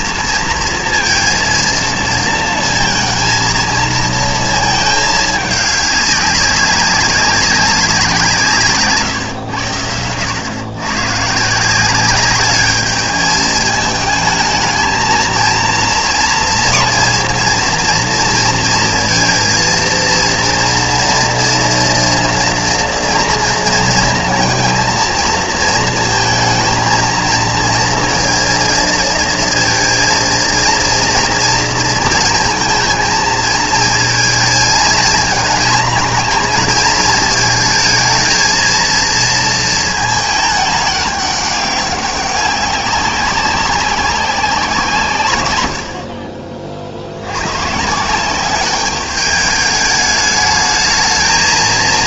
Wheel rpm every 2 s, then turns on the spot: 230, 220, 220, 200, 140, 100, 210, 220, 230, 230, 230, 230, 230, 230, 230, 230, 220, 220, 220, 230, 210, 190, 180, 40, 190, 210.
none